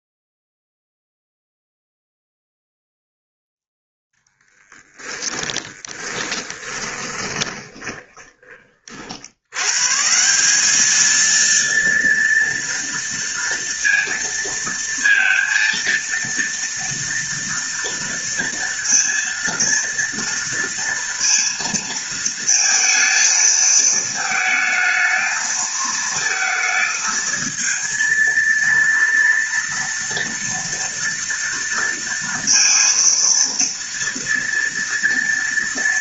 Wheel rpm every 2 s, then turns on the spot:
0, 0, 10, 20, 40, 200, 230, 230, 230, 230, 230, 230, 220, 220, 230, 230, 230, 230.
4-8